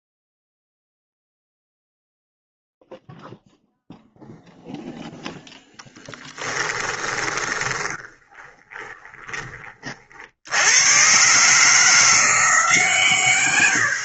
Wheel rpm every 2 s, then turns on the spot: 0, 0, 0, 10, 20, 60, 160.
6-10